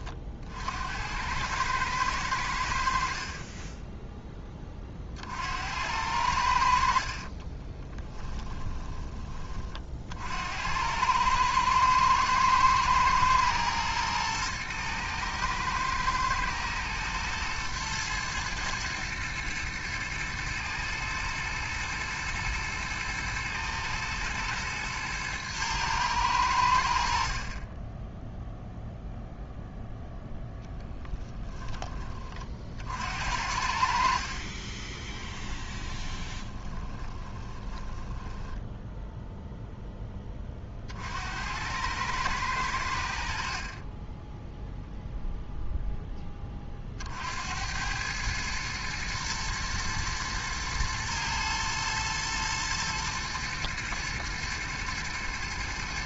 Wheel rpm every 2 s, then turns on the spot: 70, 70, 30, 50, 20, 90, 120, 110, 110, 110, 110, 110, 110, 70, 0, 20, 60, 20, 20, 10, 50, 80, 0, 40, 110, 110, 110, 110.
6-10 30-32 34-40